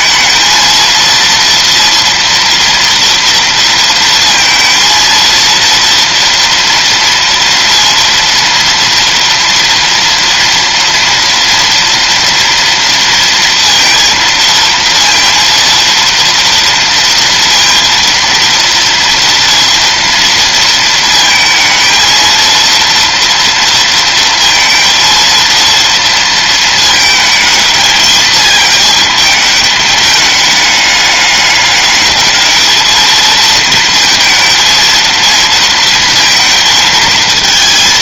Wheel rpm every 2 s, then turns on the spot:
230, 230, 230, 230, 230, 230, 230, 230, 230, 230, 220, 230, 230, 220, 220, 210, 220, 230, 230.
none